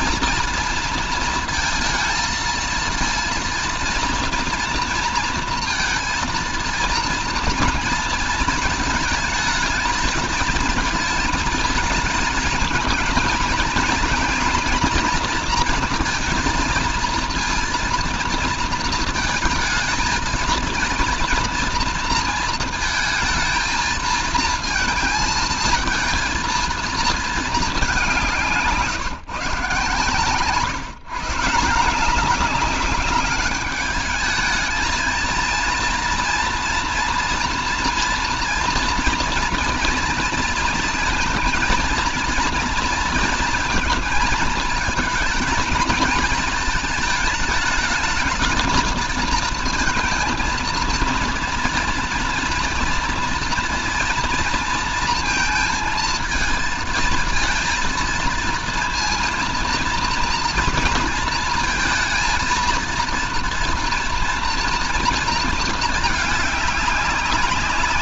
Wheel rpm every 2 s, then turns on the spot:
230, 230, 230, 230, 230, 230, 230, 230, 230, 230, 230, 230, 220, 230, 160, 140, 200, 220, 240, 230, 230, 230, 220, 220, 230, 230, 230, 230, 230, 230, 230, 230, 230, 200.
none